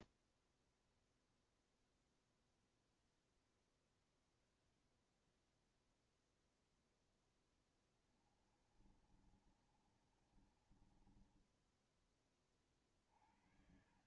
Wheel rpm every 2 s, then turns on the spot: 0, 0, 0, 0, 20, 30, 20.
8-12